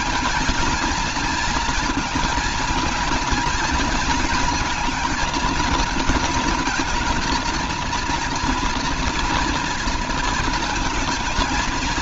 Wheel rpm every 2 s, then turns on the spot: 230, 220, 220, 230, 230, 230.
none